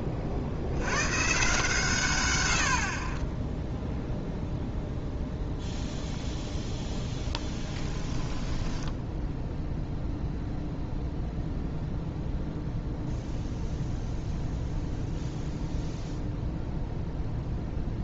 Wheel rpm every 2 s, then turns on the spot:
50, 70, 0, 0, 10, 0, 0, 0, 0.
8-10